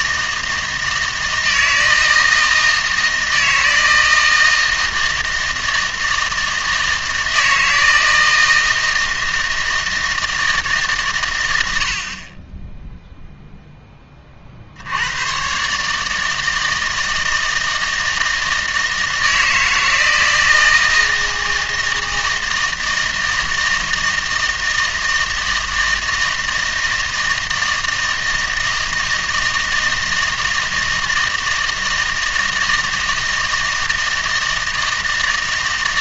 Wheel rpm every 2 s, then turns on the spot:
160, 160, 160, 160, 160, 160, 20, 60, 160, 160, 160, 160, 160, 160, 160, 160, 160, 160.
none